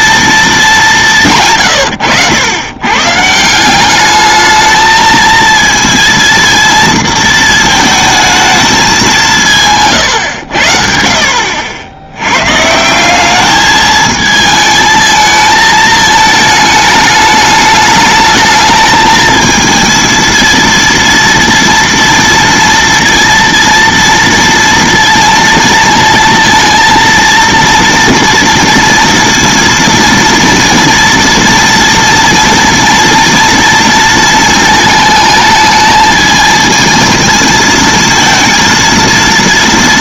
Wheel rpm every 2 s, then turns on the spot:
190, 110, 220, 230, 220, 70, 150, 220, 210, 220, 230, 230, 230, 230, 230, 230, 230, 220, 220, 230.
none